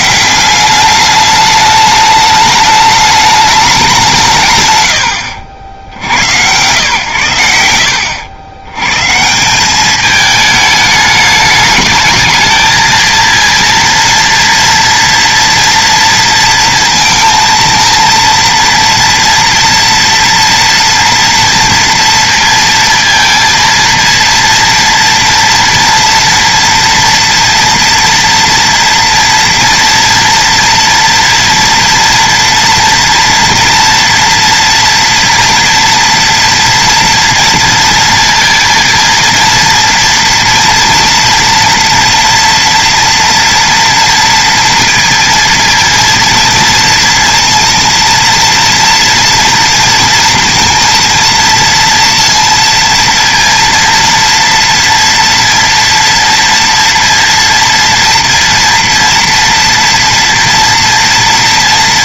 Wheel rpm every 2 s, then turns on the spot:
170, 210, 170, 80, 90, 210, 220, 230, 230, 230, 240, 230, 230, 230, 230, 230, 230, 230, 230, 230, 230, 230, 230, 230, 230, 240, 230, 230, 230, 230, 240.
none